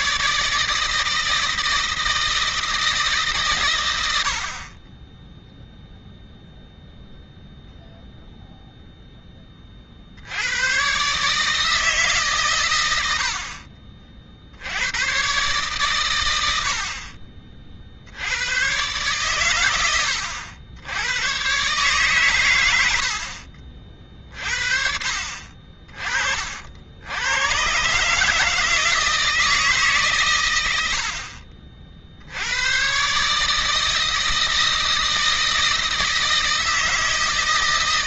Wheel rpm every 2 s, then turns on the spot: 160, 160, 30, 0, 0, 110, 100, 90, 70, 110, 100, 90, 50, 70, 160, 90, 110, 160, 160.
none